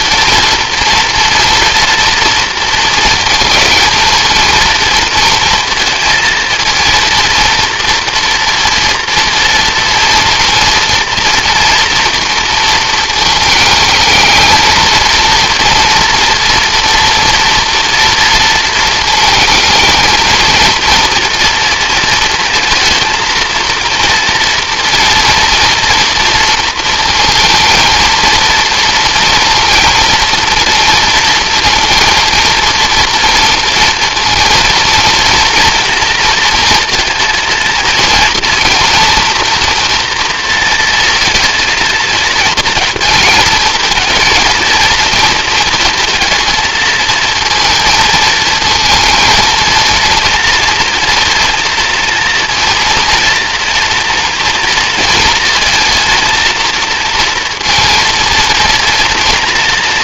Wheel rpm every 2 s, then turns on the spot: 230, 230, 230, 230, 230, 230, 230, 220, 230, 230, 230, 230, 230, 230, 230, 230, 230, 230, 230, 240, 230, 230, 220, 230, 220, 230, 230, 230, 230, 230.
none